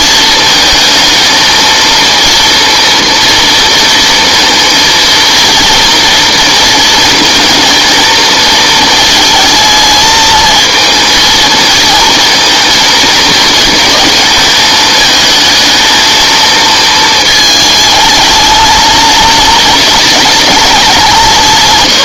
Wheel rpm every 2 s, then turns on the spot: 230, 230, 230, 230, 230, 230, 230, 220, 230, 210, 200.
none